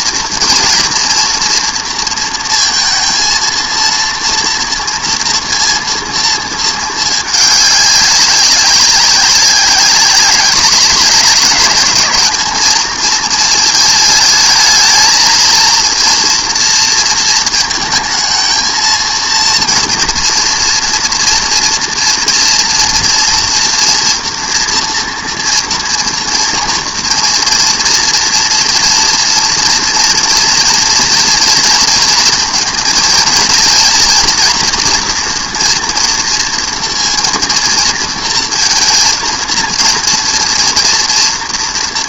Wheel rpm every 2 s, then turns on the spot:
230, 230, 230, 230, 190, 200, 210, 220, 230, 230, 230, 230, 230, 230, 230, 230, 230, 230, 230, 230, 230.
none